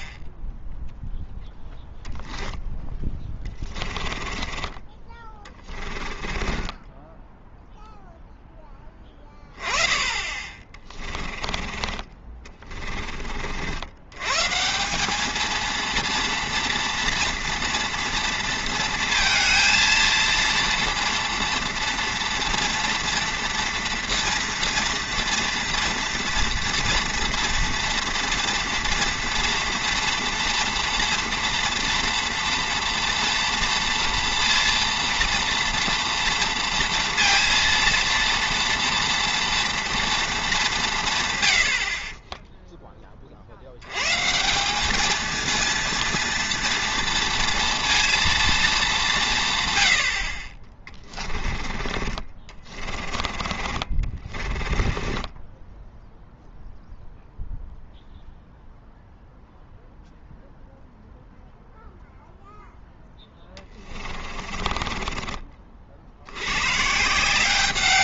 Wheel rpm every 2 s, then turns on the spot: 0, 10, 30, 20, 10, 20, 30, 170, 230, 230, 230, 240, 230, 230, 230, 240, 230, 230, 230, 230, 190, 0, 180, 230, 220, 30, 30, 30, 0, 0, 0, 0, 30, 130.
4-8 10-14 52-56 64-66